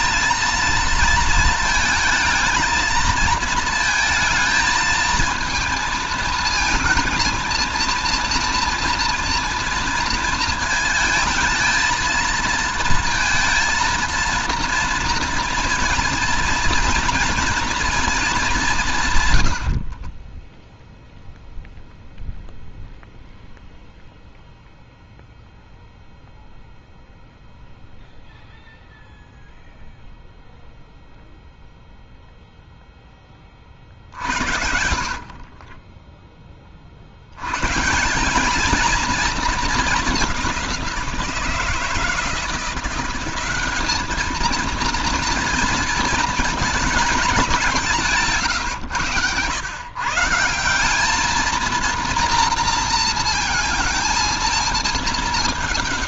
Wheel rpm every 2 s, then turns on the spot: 220, 220, 220, 230, 230, 220, 230, 230, 240, 190, 10, 0, 0, 0, 0, 0, 0, 70, 30, 210, 190, 170, 220, 220, 140, 170, 230, 220.
none